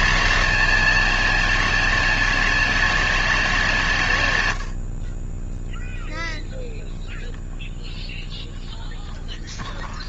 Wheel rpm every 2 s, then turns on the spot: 110, 280, 250, 10, 0.
none